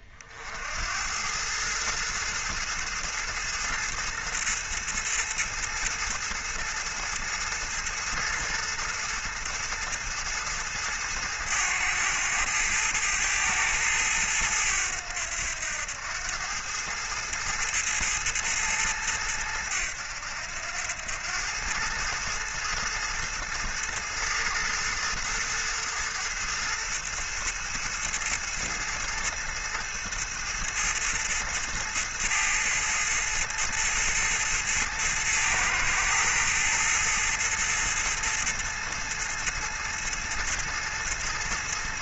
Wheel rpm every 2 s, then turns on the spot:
70, 110, 110, 110, 110, 110, 110, 100, 100, 110, 90, 110, 110, 110, 110, 110, 110, 110, 110, 110, 110.
none